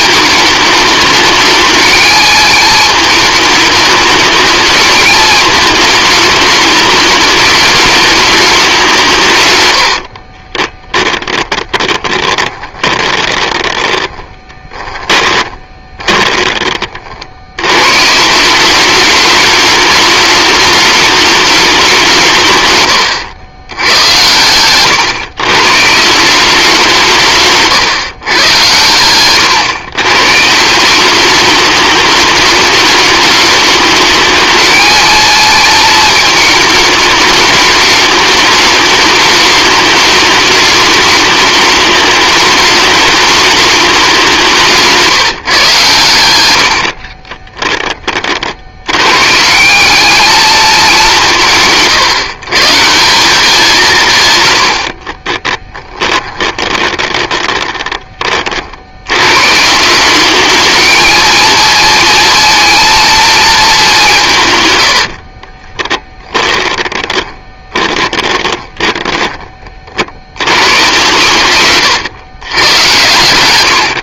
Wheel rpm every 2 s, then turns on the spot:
210, 220, 220, 210, 180, 20, 20, 20, 40, 200, 210, 120, 130, 170, 110, 170, 210, 220, 210, 210, 210, 210, 170, 60, 100, 200, 170, 60, 20, 70, 220, 230, 100, 20, 20, 120, 110.
10-16 22-26 44-48 54-58 64-70